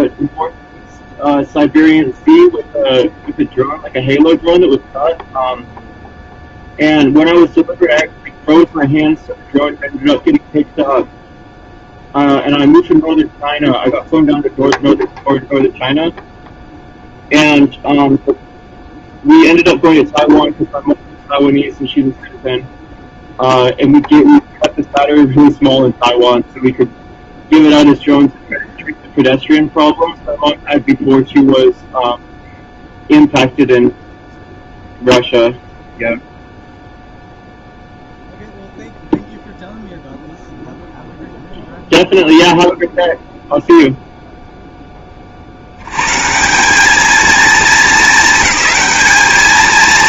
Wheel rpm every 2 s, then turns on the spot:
0, 0, 0, 0, 0, 0, 0, 0, 0, 0, 0, 0, 0, 0, 0, 0, 0, 0, 0, 0, 0, 0, 10, 200, 220.
none